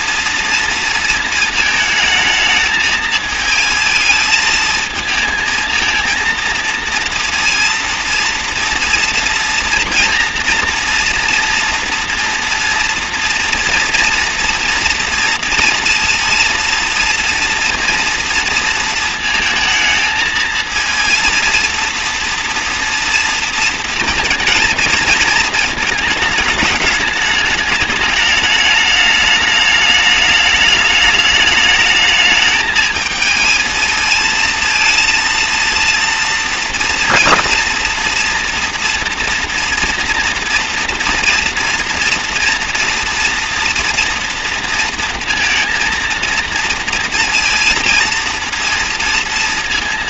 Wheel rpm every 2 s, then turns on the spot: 230, 220, 220, 230, 230, 230, 230, 230, 230, 230, 220, 230, 230, 210, 210, 210, 220, 220, 230, 230, 230, 230, 230, 230, 230.
none